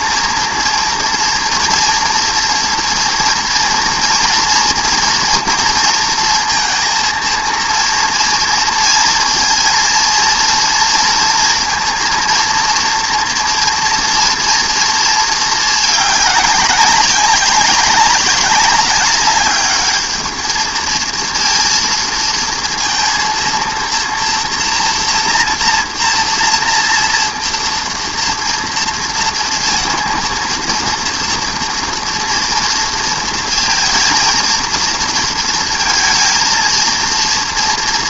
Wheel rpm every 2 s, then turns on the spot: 230, 240, 230, 230, 230, 230, 230, 230, 220, 190, 200, 230, 230, 230, 230, 230, 230, 230, 230.
none